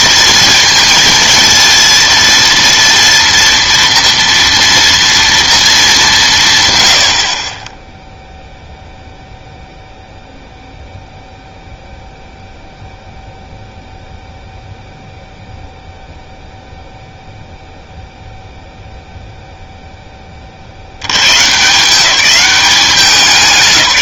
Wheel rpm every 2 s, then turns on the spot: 230, 230, 230, 130, 0, 0, 0, 0, 0, 0, 50, 200.
none